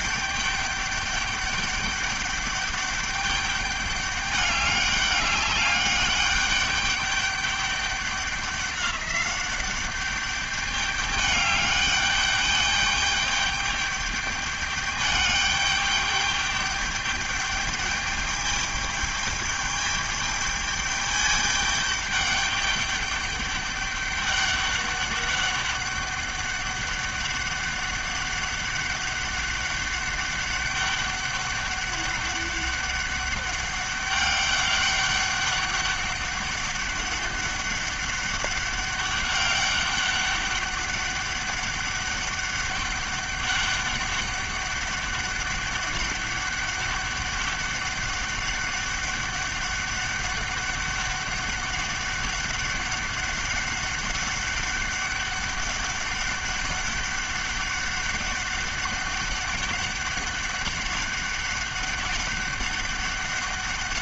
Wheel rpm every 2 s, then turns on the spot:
200, 200, 200, 200, 200, 200, 200, 210, 210, 210, 210, 200, 200, 200, 200, 200, 200, 200, 200, 200, 200, 200, 200, 200, 200, 200, 200, 200, 200, 200, 200, 200.
none